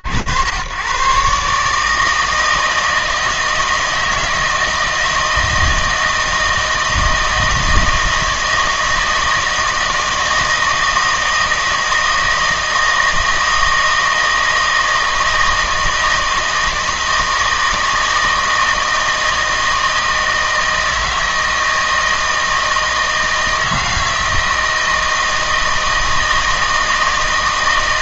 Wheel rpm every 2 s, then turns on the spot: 60, 160, 160, 160, 160, 160, 160, 160, 160, 160, 160, 160, 160, 160.
none